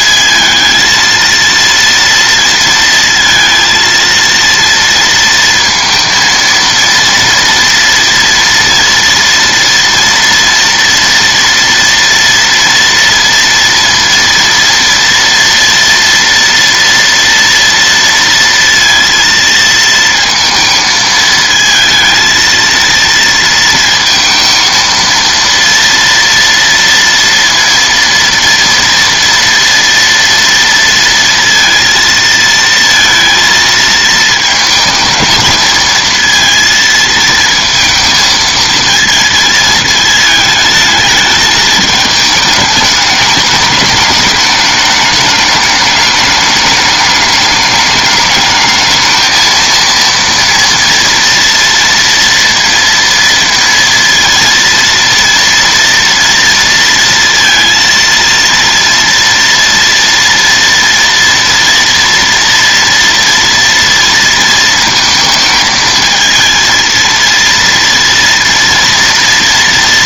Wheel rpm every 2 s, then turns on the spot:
230, 230, 230, 230, 230, 230, 230, 230, 230, 230, 220, 230, 230, 230, 230, 230, 230, 220, 230, 230, 220, 210, 210, 210, 220, 230, 230, 230, 230, 230, 230, 230, 220, 230, 230.
none